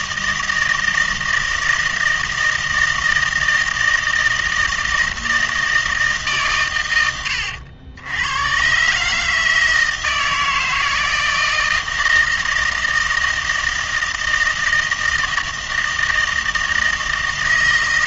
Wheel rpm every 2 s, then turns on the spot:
160, 160, 160, 120, 130, 160, 160, 170, 160.
none